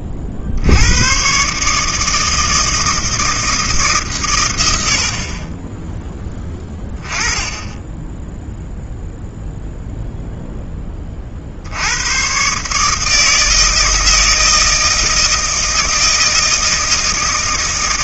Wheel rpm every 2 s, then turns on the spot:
70, 160, 90, 10, 0, 20, 150, 160, 160.
none